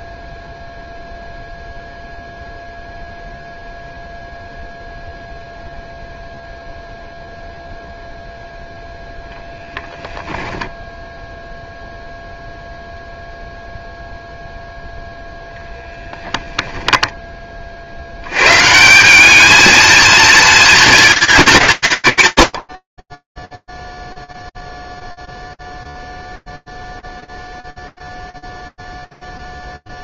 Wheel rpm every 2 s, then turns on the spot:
0, 0, 0, 0, 10, 0, 0, 10, 70, 230, 190, 20, 0, 0, 0.
8-10 14-16